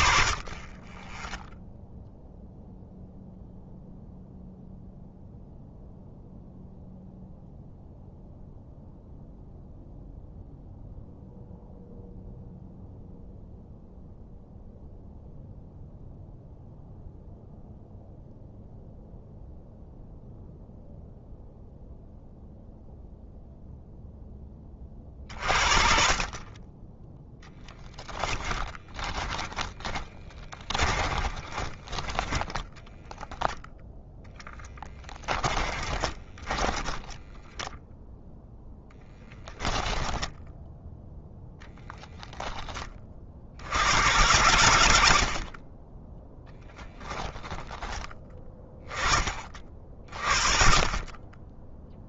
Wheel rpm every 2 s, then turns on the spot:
30, 0, 0, 0, 0, 0, 0, 0, 0, 0, 0, 0, 40, 30, 10, 20, 10, 10, 10, 0, 0, 20, 100, 10, 20, 50.
28-38 46-48